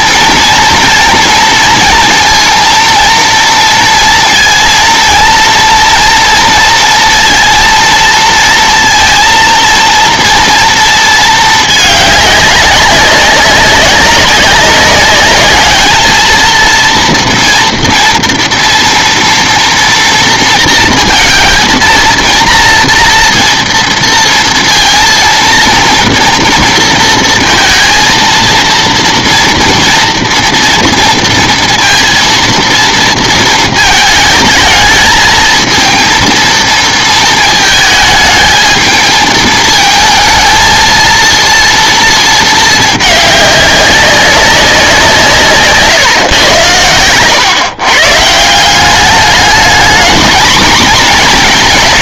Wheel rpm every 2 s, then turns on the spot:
230, 230, 230, 230, 230, 230, 200, 190, 230, 230, 230, 230, 230, 230, 230, 230, 230, 220, 230, 220, 230, 220, 190, 110, 170, 230.
none